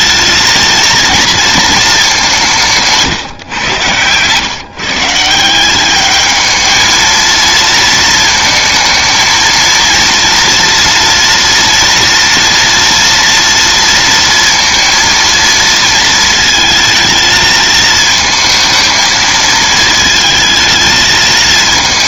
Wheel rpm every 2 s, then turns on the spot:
230, 160, 150, 220, 230, 230, 230, 230, 220, 220, 230.
2-4